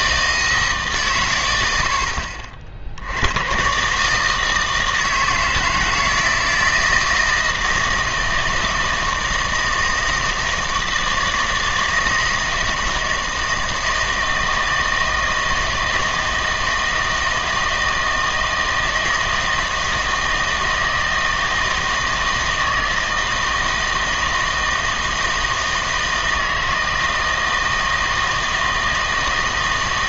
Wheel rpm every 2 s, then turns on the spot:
140, 60, 160, 160, 160, 160, 160, 160, 160, 160, 160, 160, 160, 160, 160.
none